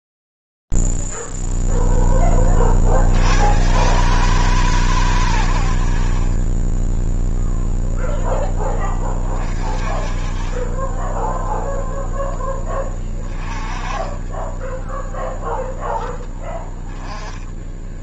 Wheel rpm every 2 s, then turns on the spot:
0, 10, 120, 70, 0, 30, 0, 10, 0.
14-16